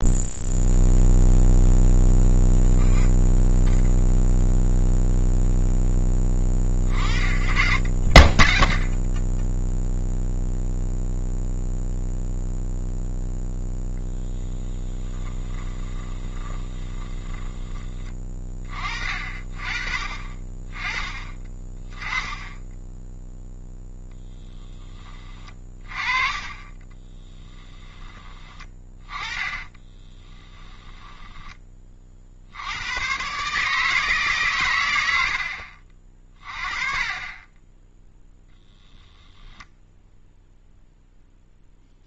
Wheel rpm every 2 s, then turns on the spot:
0, 0, 0, 40, 0, 0, 0, 10, 20, 40, 20, 10, 10, 20, 20, 10, 90, 110, 30, 0, 0.
14-18 26-32